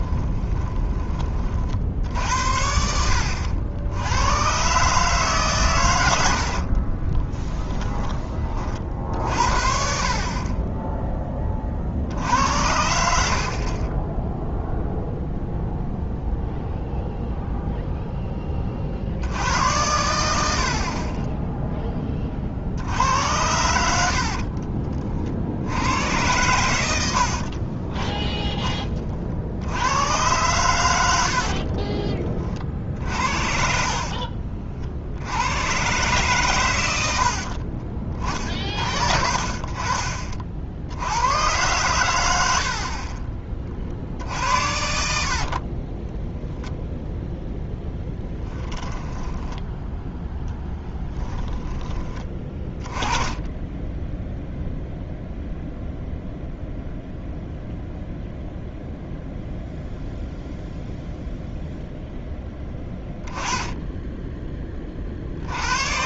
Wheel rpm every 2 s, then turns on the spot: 10, 70, 130, 50, 40, 20, 70, 0, 0, 40, 60, 60, 40, 100, 20, 110, 50, 60, 110, 50, 60, 70, 60, 0, 10, 10, 20, 0, 0, 0, 0, 10, 30.
6-8 24-26 48-50